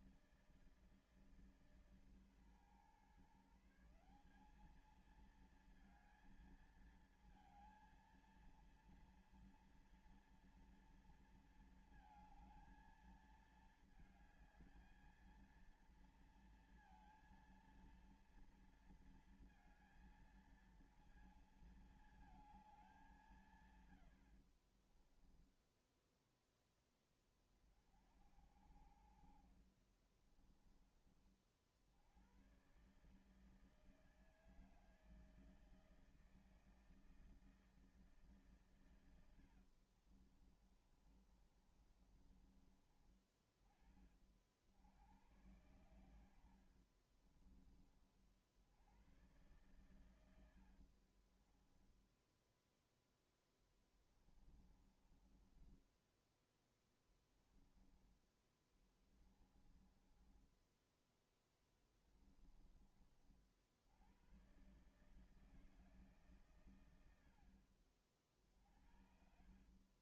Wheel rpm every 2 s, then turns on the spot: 160, 140, 200, 220, 230, 230, 230, 220, 230, 230, 230, 210, 50, 10, 60, 20, 110, 160, 160, 140, 40, 30, 50, 60, 60, 80, 0, 20, 10, 20, 10, 20, 120, 130, 60.
24-26 30-32 40-42 46-48 50-52 54-62